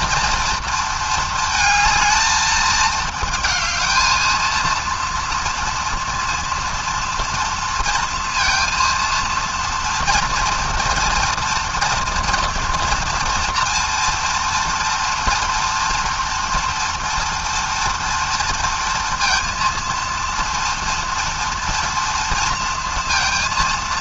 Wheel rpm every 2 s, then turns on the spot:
230, 220, 230, 230, 230, 230, 240, 230, 230, 230, 230, 230.
none